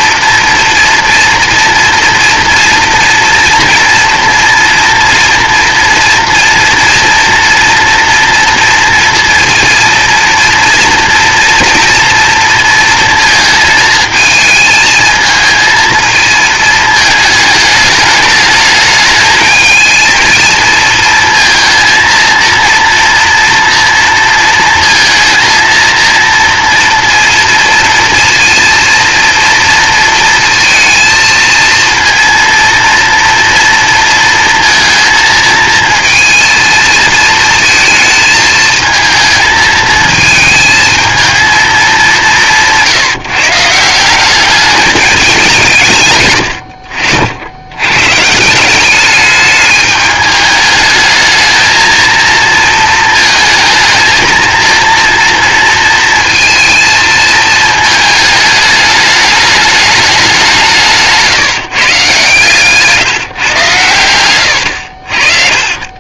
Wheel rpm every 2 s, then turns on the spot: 230, 230, 230, 230, 230, 230, 230, 220, 220, 210, 220, 230, 230, 230, 230, 230, 230, 230, 230, 220, 220, 150, 210, 80, 190, 210, 220, 230, 230, 210, 170, 140, 70.
none